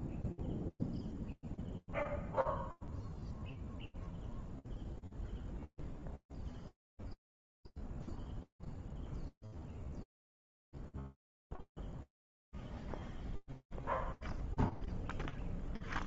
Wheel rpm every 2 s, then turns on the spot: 0, 0, 0, 0, 0, 0, 0, 0.
none